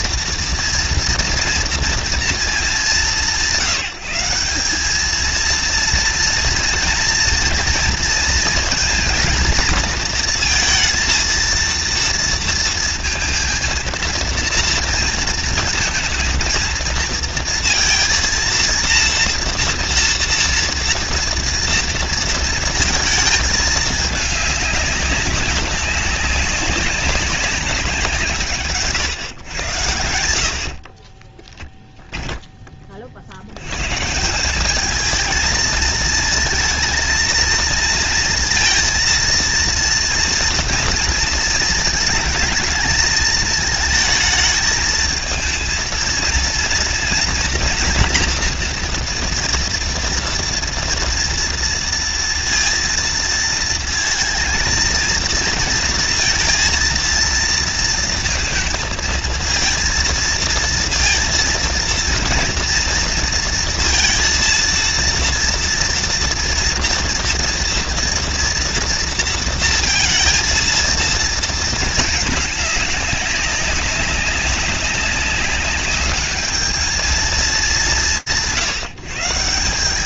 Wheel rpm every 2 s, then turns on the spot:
230, 180, 210, 230, 230, 230, 230, 230, 230, 230, 230, 220, 200, 190, 140, 40, 40, 220, 220, 230, 230, 220, 220, 230, 240, 230, 230, 230, 230, 230, 230, 230, 230, 230, 240, 230, 200, 200, 210, 150.
30-32